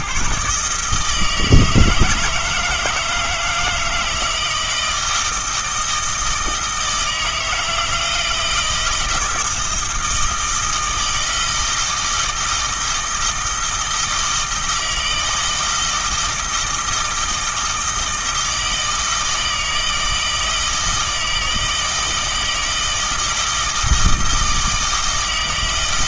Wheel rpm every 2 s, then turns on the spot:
150, 160, 160, 160, 160, 160, 160, 160, 160, 160, 160, 160, 160.
none